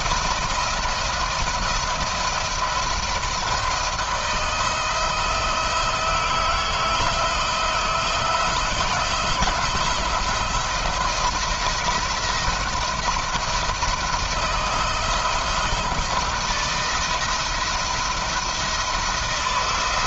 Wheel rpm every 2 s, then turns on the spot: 170, 170, 170, 160, 170, 170, 160, 160, 170, 160.
none